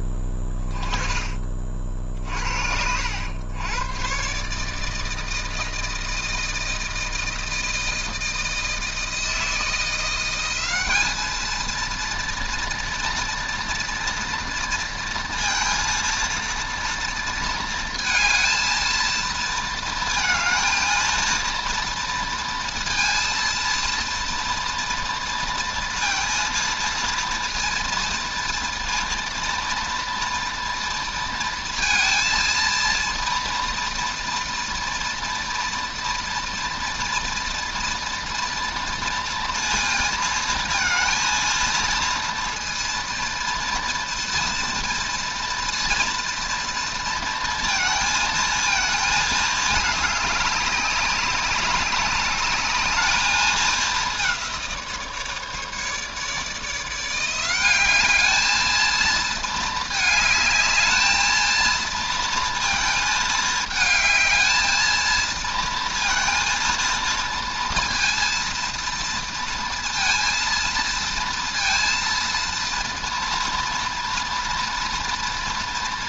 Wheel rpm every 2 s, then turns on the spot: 20, 60, 150, 160, 160, 200, 230, 230, 230, 230, 230, 230, 240, 230, 230, 230, 230, 230, 240, 230, 230, 230, 230, 230, 230, 200, 210, 170, 160, 220, 210, 230, 220, 230, 230, 230, 230, 230.
none